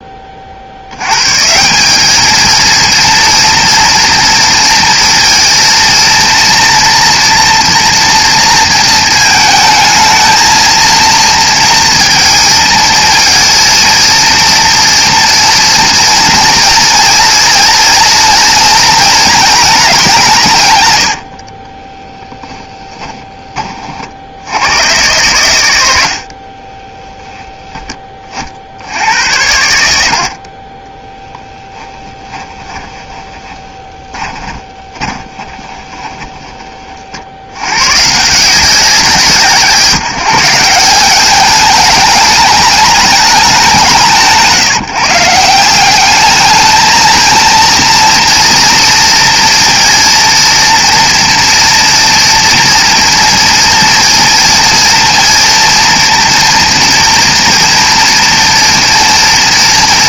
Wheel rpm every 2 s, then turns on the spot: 70, 230, 230, 230, 230, 230, 220, 230, 230, 230, 140, 10, 110, 30, 60, 30, 10, 20, 40, 170, 170, 210, 160, 220, 230, 230, 230, 230, 230, 240.
22-24 26-28 32-36